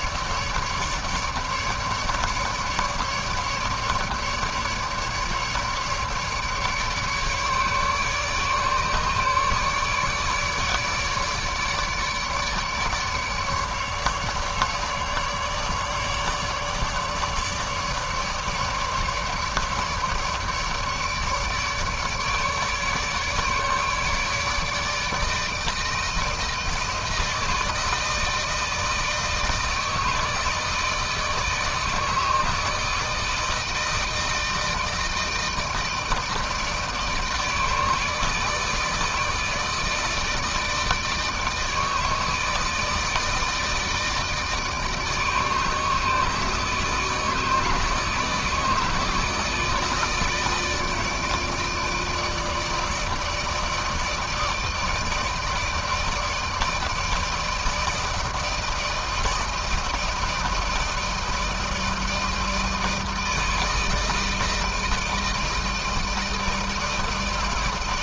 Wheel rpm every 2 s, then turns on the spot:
150, 150, 150, 150, 150, 150, 150, 150, 150, 150, 150, 150, 150, 160, 160, 160, 160, 160, 160, 150, 160, 160, 150, 160, 160, 160, 160, 160, 160, 160, 160, 160, 160, 160.
none